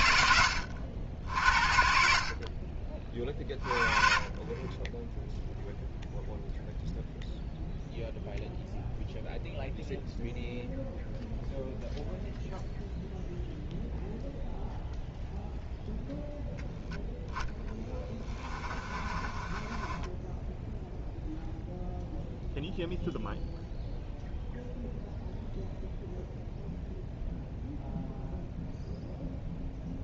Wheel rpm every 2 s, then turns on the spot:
90, 40, 20, 0, 0, 0, 0, 0, 0, 20, 10, 0, 0, 0, 0.
18-20